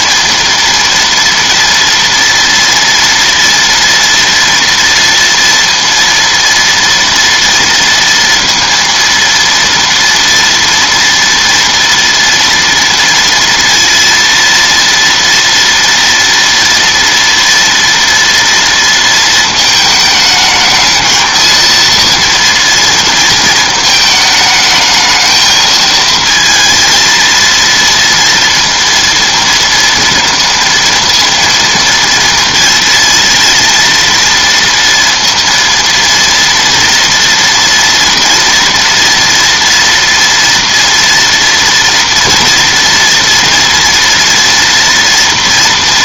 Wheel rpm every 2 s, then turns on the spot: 230, 240, 230, 230, 230, 230, 230, 230, 230, 230, 220, 230, 210, 230, 230, 230, 230, 230, 230, 240, 230, 230, 230.
none